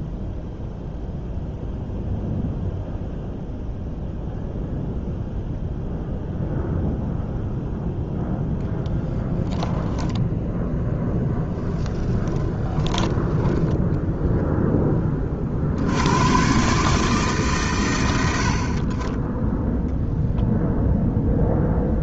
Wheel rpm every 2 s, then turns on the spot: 0, 0, 0, 0, 0, 10, 20, 10, 140, 40, 0.
12-14